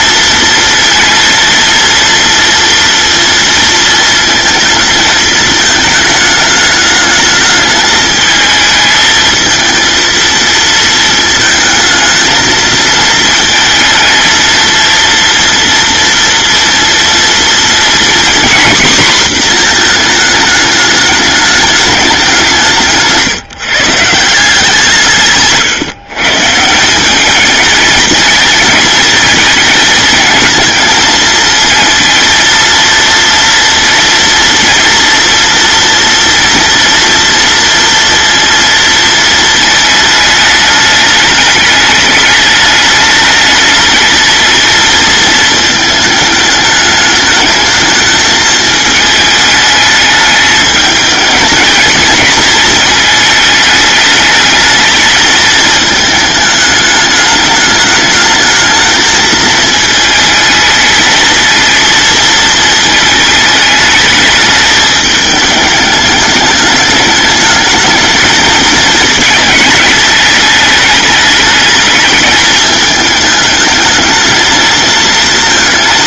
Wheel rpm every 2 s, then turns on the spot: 230, 230, 220, 220, 220, 220, 220, 230, 240, 240, 210, 150, 160, 190, 230, 220, 230, 230, 230, 230, 210, 220, 230, 210, 220, 220, 220, 220, 210, 220, 220, 220, 220, 210, 220, 210, 220, 220.
none